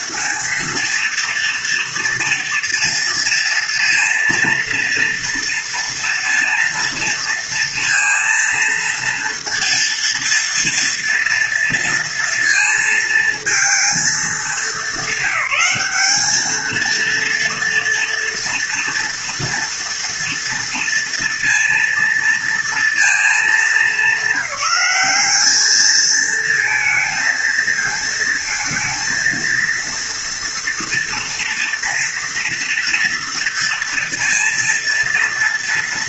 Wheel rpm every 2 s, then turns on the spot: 240, 230, 230, 230, 230, 230, 230, 220, 230, 230, 230, 230, 190, 230, 230, 230, 230, 230.
none